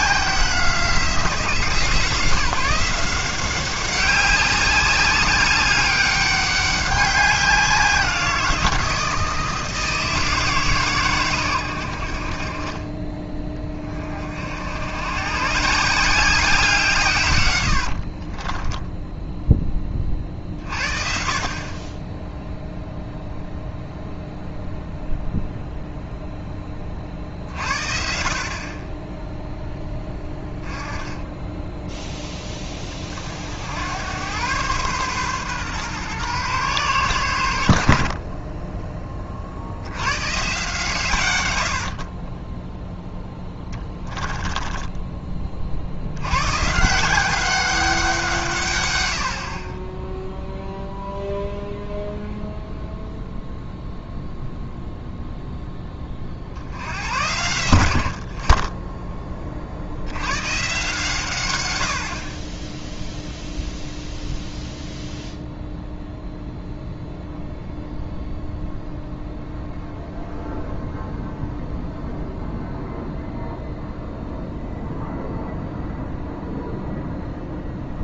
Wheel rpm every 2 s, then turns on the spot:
180, 170, 190, 190, 170, 150, 30, 80, 170, 10, 50, 0, 0, 20, 30, 10, 20, 120, 120, 20, 140, 10, 10, 140, 140, 0, 0, 0, 70, 20, 130, 10, 0, 0, 0, 0, 0, 0, 0.
18-20 42-46